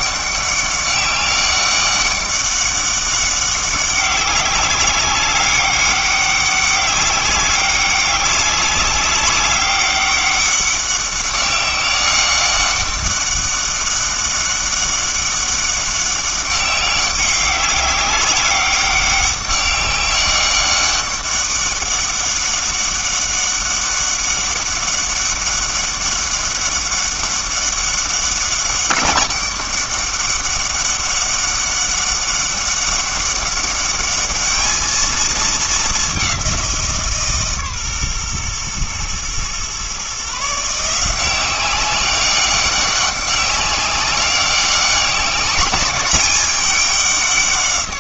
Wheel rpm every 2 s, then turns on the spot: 200, 200, 200, 200, 190, 200, 200, 200, 200, 200, 200, 200, 200, 200, 200, 200, 200, 220, 170, 120, 160, 200, 190, 190.
none